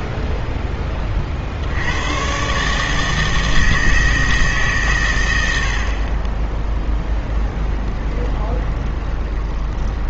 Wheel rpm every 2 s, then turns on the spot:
10, 140, 140, 10, 20.
8-10